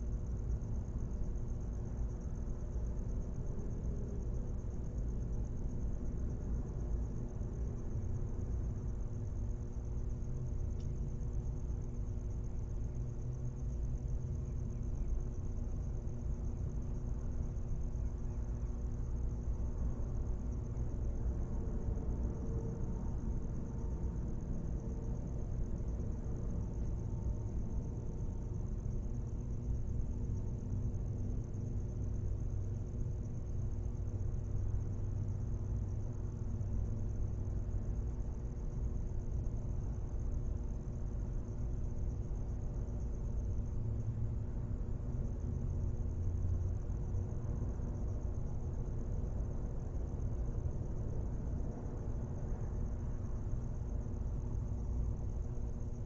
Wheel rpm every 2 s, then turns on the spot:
0, 0, 0, 0, 0, 0, 0, 0, 0, 0, 0, 0, 0, 0, 0, 0, 0, 0, 0, 0, 0, 0, 0, 0, 0, 0, 0, 0.
none